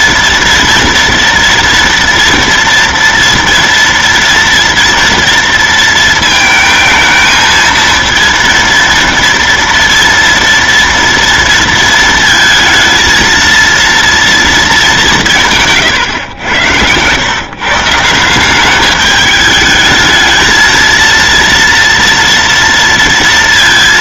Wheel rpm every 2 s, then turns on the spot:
240, 240, 240, 220, 230, 230, 230, 220, 110, 190, 220, 230.
16-18